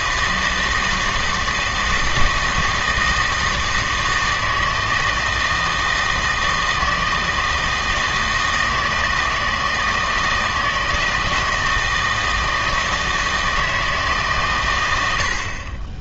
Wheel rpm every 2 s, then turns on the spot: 160, 160, 160, 160, 160, 160, 160, 110.
none